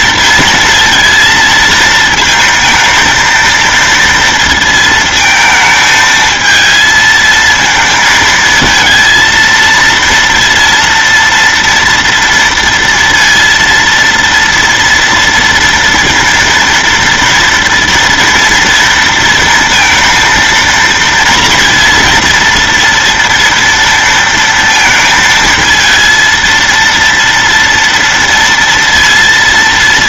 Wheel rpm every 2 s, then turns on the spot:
230, 220, 230, 220, 230, 230, 230, 230, 230, 230, 230, 230, 230, 230, 230.
none